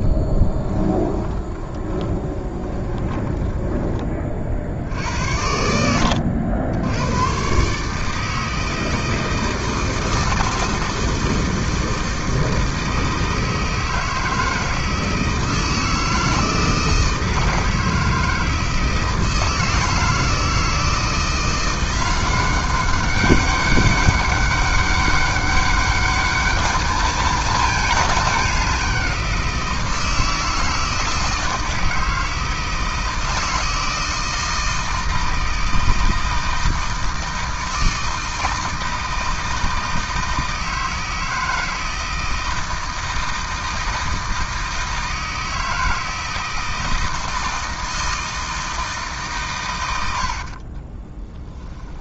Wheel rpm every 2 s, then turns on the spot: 10, 20, 60, 90, 160, 160, 160, 160, 160, 160, 160, 190, 200, 210, 190, 160, 160, 160, 160, 160, 160, 160, 160, 160, 160, 30.
0-4 50-52